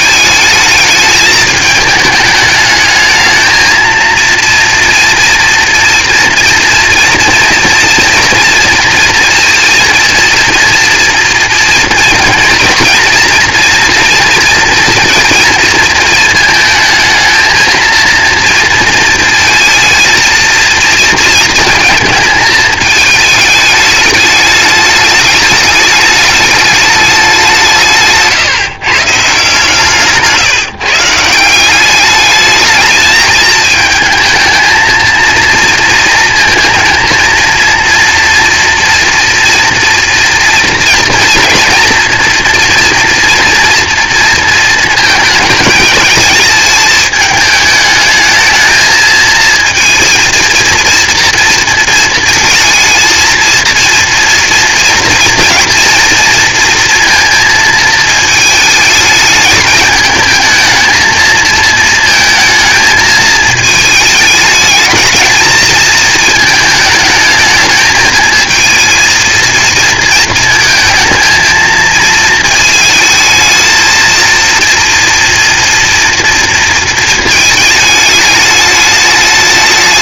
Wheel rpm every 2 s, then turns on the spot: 220, 210, 230, 230, 230, 230, 230, 230, 220, 230, 230, 220, 210, 220, 150, 150, 220, 220, 220, 230, 240, 240, 230, 220, 220, 230, 220, 240, 230, 220, 220, 220, 220, 220, 230, 220, 220, 230, 220, 210.
none